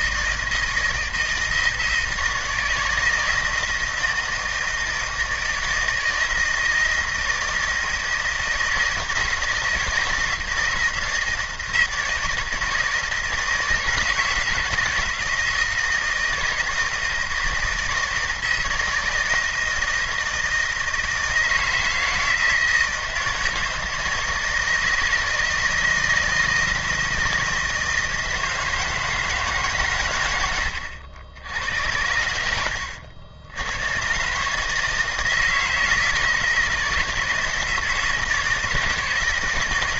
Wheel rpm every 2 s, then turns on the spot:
160, 160, 160, 160, 160, 160, 160, 160, 160, 160, 160, 160, 160, 160, 160, 90, 90, 150, 160, 160.
32-34